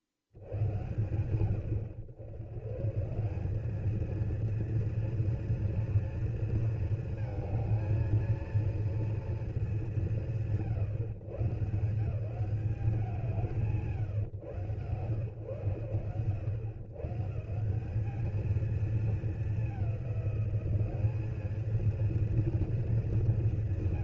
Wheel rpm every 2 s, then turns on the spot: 70, 100, 230, 230, 230, 110, 180, 120, 110, 220, 190, 220.
none